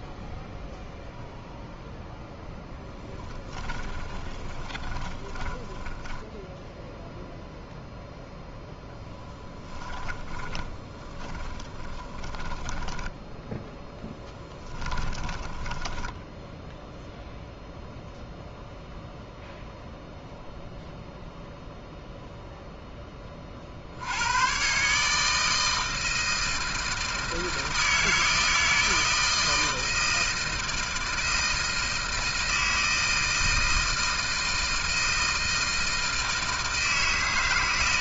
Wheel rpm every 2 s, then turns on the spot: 0, 0, 20, 0, 0, 20, 10, 10, 0, 0, 0, 0, 110, 160, 160, 160, 160, 160, 160.
4-6 10-16